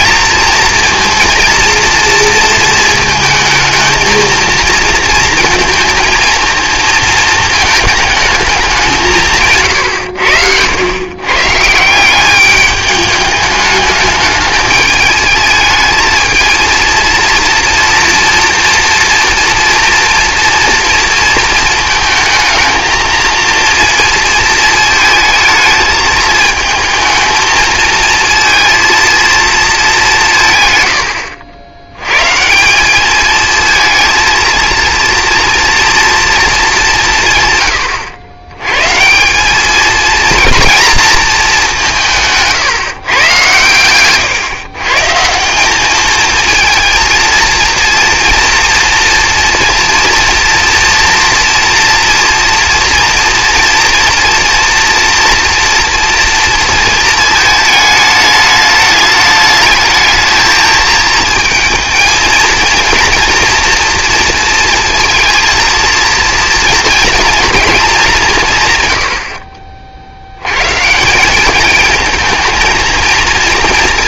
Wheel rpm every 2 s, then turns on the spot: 230, 230, 230, 230, 190, 100, 200, 210, 230, 240, 230, 220, 220, 220, 230, 120, 180, 220, 200, 120, 230, 150, 140, 220, 230, 230, 230, 230, 220, 210, 220, 230, 230, 230, 140, 130, 220.
none